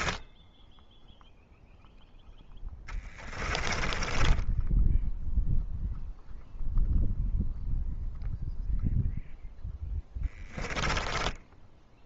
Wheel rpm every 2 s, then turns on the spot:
0, 20, 0, 0, 0, 10.
2-4 10-12